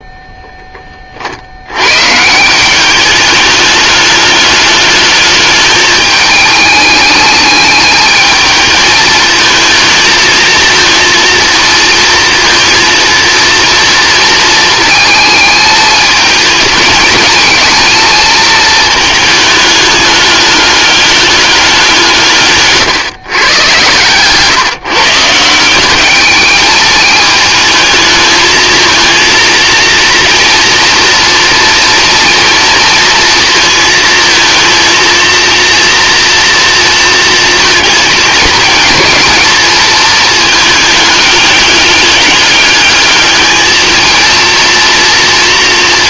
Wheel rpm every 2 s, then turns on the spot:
30, 200, 210, 210, 220, 230, 230, 220, 220, 220, 210, 130, 150, 220, 220, 230, 230, 230, 230, 220, 210, 210, 230.
none